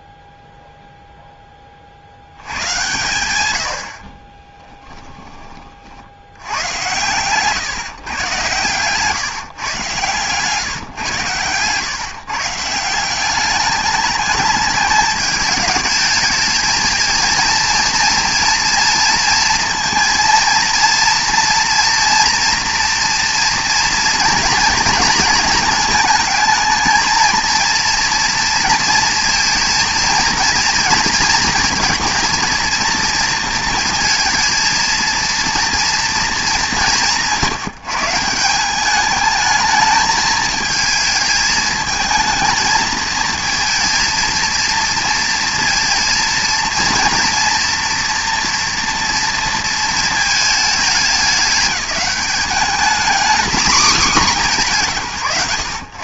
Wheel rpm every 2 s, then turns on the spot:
0, 100, 10, 100, 130, 140, 170, 210, 220, 240, 230, 230, 240, 230, 230, 230, 230, 230, 190, 190, 220, 220, 230, 230, 240, 210, 220, 180.
4-6 8-10